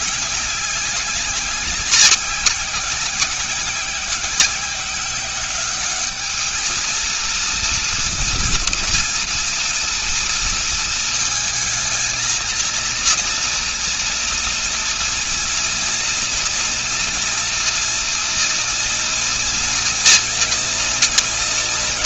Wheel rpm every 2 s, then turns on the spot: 200, 190, 180, 210, 230, 230, 230, 230, 230, 230, 240.
none